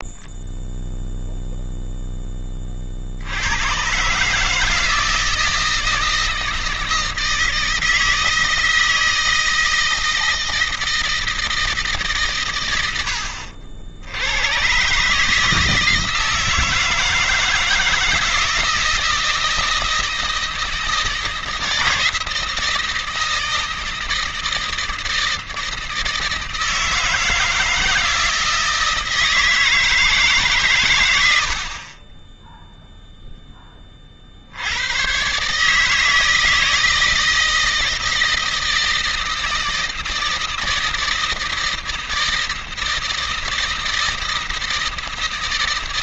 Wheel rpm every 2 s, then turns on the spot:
0, 40, 160, 160, 160, 160, 90, 130, 160, 160, 160, 160, 160, 160, 160, 130, 0, 80, 160, 160, 160, 160, 160.
none